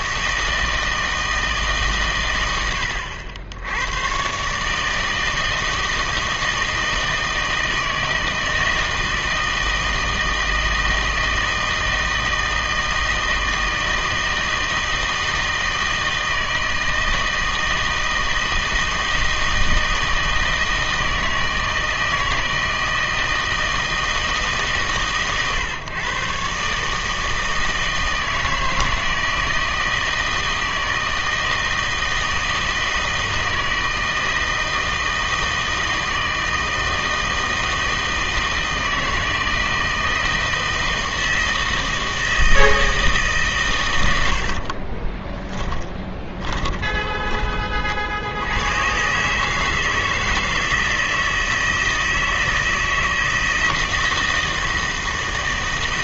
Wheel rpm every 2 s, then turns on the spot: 160, 90, 150, 160, 160, 160, 160, 160, 160, 160, 160, 160, 150, 140, 160, 160, 160, 160, 160, 160, 160, 160, 50, 20, 100, 160, 160, 160.
44-48